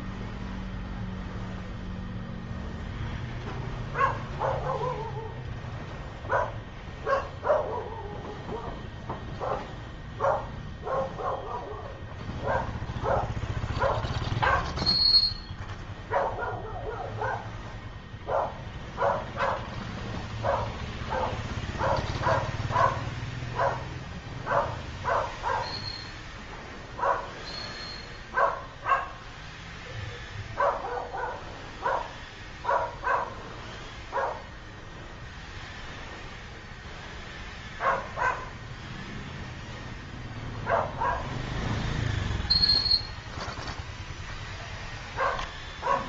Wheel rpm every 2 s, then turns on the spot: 0, 0, 0, 0, 0, 0, 0, 0, 0, 0, 0, 0, 0, 0, 0, 0, 0, 0, 0, 0, 0, 0, 0.
none